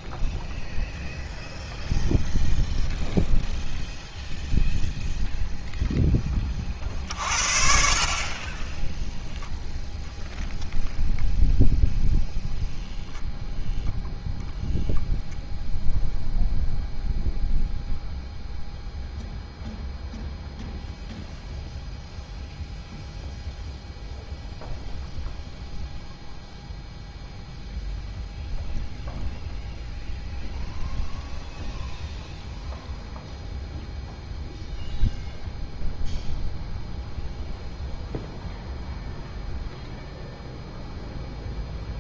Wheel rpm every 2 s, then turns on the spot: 0, 0, 0, 40, 10, 0, 0, 0, 0, 0, 0, 0, 0, 0, 0, 0, 0, 0, 0, 0, 0.
8-10